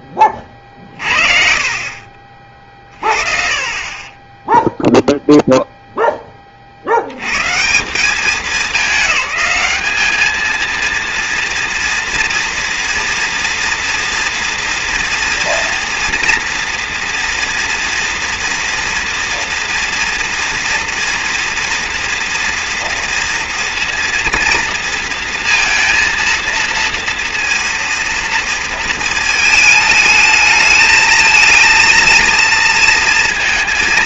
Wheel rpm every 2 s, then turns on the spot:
30, 50, 0, 50, 210, 230, 230, 230, 230, 230, 230, 230, 230, 230, 220, 220, 230.
none